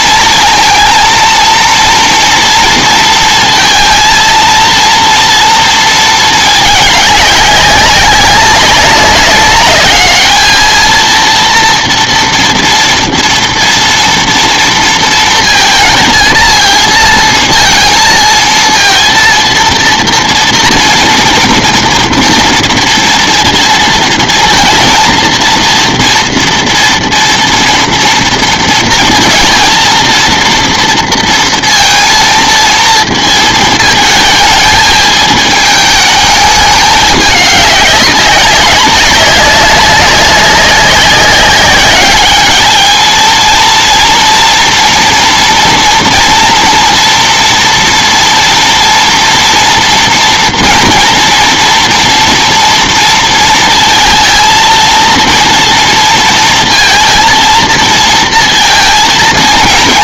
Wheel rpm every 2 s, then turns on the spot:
230, 230, 230, 210, 200, 220, 230, 230, 230, 230, 240, 230, 230, 230, 230, 230, 230, 220, 210, 190, 200, 210, 230, 230, 230, 230, 230, 220, 230, 230.
none